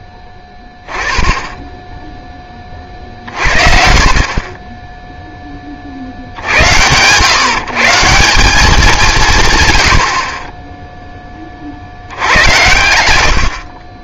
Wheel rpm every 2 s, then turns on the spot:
10, 50, 10, 80, 190, 10, 90.
12-14